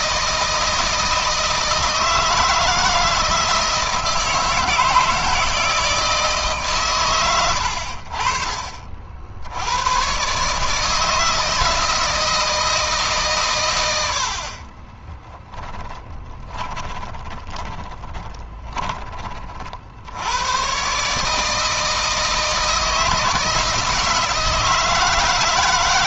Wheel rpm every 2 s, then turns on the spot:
160, 160, 160, 110, 50, 150, 150, 20, 20, 20, 130, 160, 160.
14-18